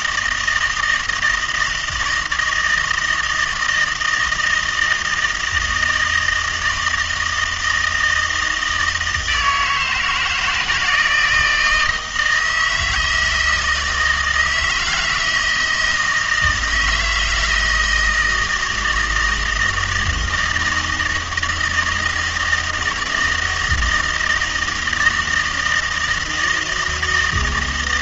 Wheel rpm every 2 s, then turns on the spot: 160, 160, 160, 160, 160, 160, 160, 160, 170, 160, 170, 160, 160, 160.
none